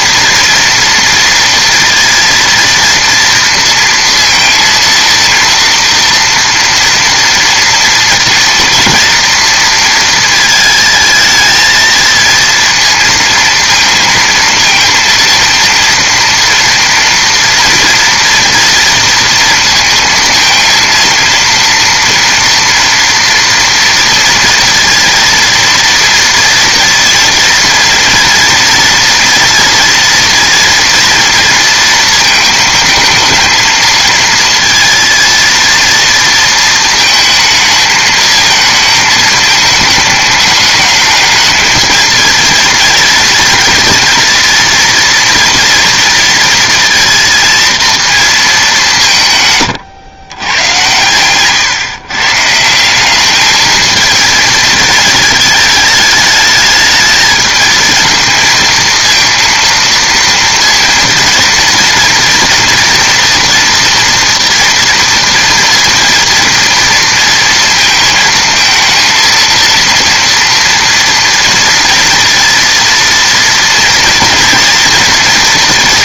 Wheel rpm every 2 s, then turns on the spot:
230, 230, 230, 230, 230, 220, 230, 230, 230, 230, 230, 230, 230, 230, 240, 230, 220, 230, 220, 220, 210, 230, 230, 230, 200, 110, 160, 220, 220, 220, 230, 230, 230, 230, 230, 230, 230, 230.
none